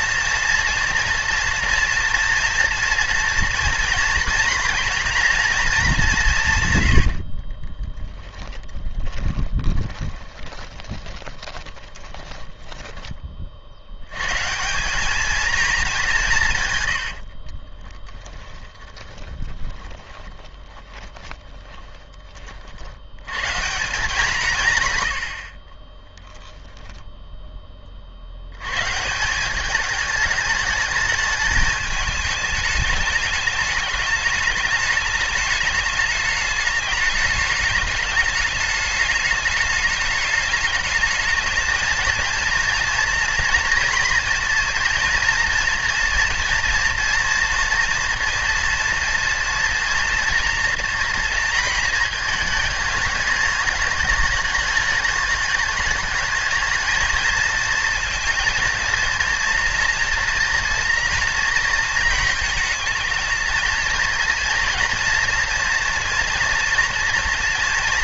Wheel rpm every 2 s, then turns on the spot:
230, 230, 240, 130, 20, 20, 10, 170, 120, 20, 30, 50, 150, 0, 120, 220, 210, 210, 210, 210, 220, 230, 230, 230, 230, 230, 220, 210, 220, 230, 230, 220, 230, 240.
8-14 16-22